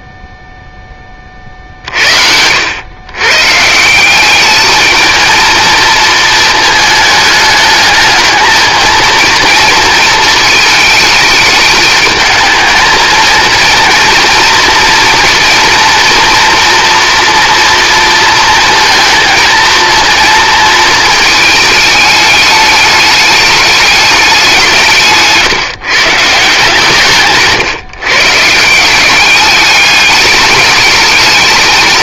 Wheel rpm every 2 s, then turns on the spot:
10, 90, 210, 220, 220, 220, 220, 230, 230, 230, 220, 210, 180, 150, 170, 210.
none